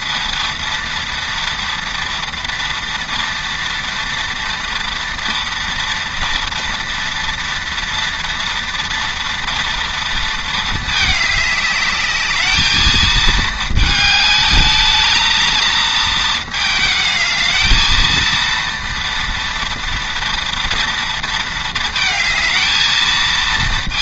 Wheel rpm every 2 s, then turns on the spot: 230, 230, 230, 230, 230, 220, 220, 220, 220, 230, 230, 220.
none